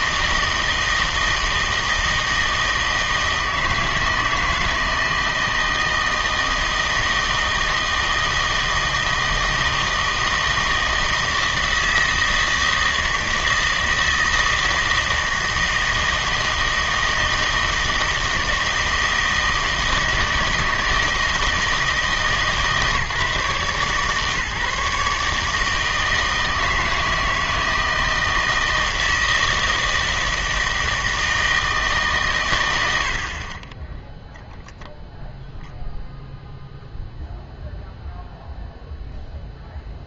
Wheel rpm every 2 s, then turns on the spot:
160, 160, 160, 160, 160, 160, 160, 160, 160, 160, 160, 150, 150, 160, 160, 160, 110, 0, 0, 0.
none